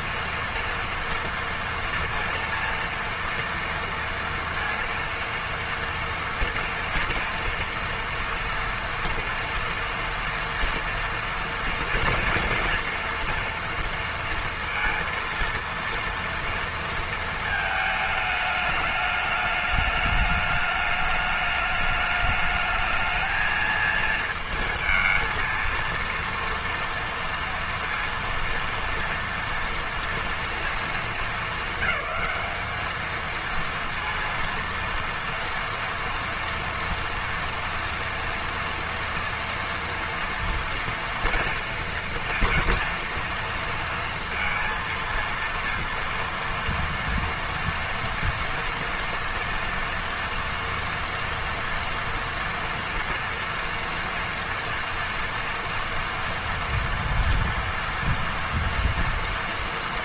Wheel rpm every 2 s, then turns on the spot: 240, 230, 230, 230, 230, 230, 230, 230, 230, 210, 210, 220, 220, 230, 230, 210, 220, 230, 230, 230, 230, 230, 230, 230, 230, 230, 230, 230, 230, 230.
none